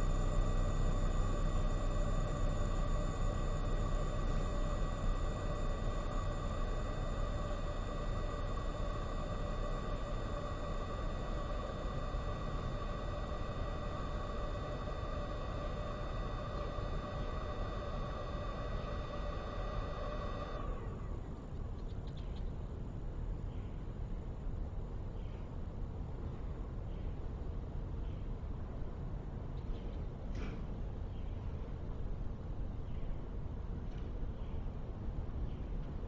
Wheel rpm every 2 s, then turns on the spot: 0, 0, 0, 0, 0, 0, 0, 0, 0, 0, 0, 0, 0, 0, 0, 0, 0, 0.
none